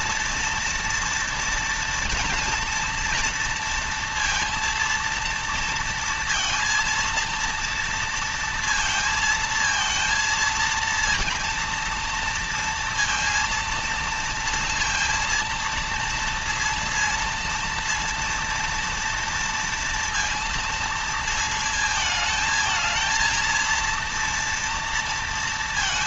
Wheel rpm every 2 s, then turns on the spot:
230, 230, 230, 230, 230, 230, 230, 230, 230, 230, 230, 220, 230.
none